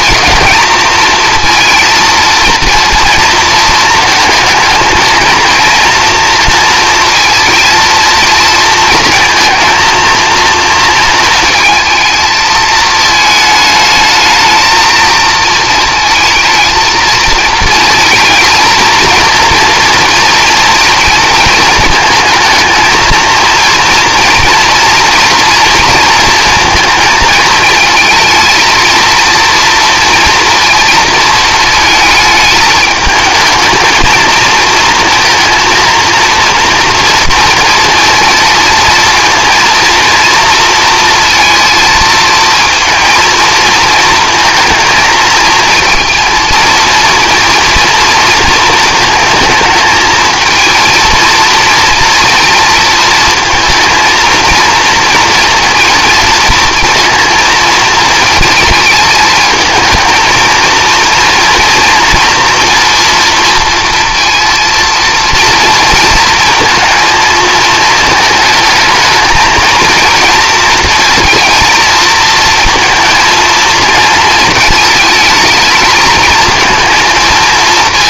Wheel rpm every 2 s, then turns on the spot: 220, 230, 220, 230, 230, 220, 220, 220, 230, 230, 230, 230, 240, 230, 230, 230, 210, 230, 230, 230, 230, 230, 230, 230, 230, 220, 230, 230, 230, 220, 230, 230, 230, 230, 210, 230, 230, 220, 230.
none